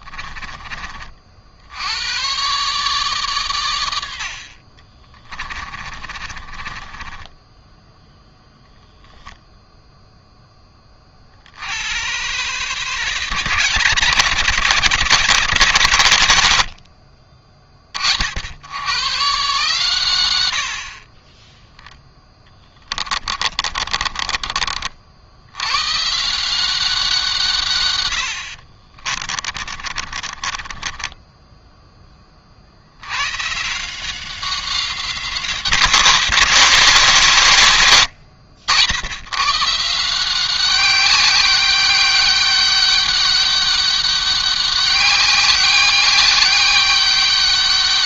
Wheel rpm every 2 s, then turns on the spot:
30, 140, 50, 30, 0, 20, 140, 170, 70, 100, 60, 10, 50, 180, 50, 30, 70, 180, 180, 80, 190, 200, 200, 200.
4-8 22-24 28-32